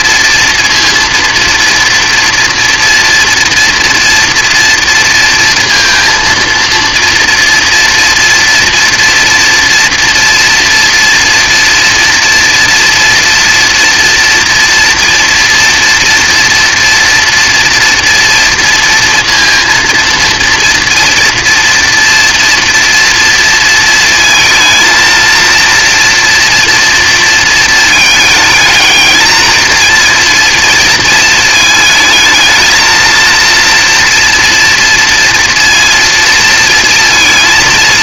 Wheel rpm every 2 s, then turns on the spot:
230, 230, 230, 230, 230, 230, 230, 230, 230, 230, 230, 230, 220, 230, 220, 230, 220, 230, 230.
none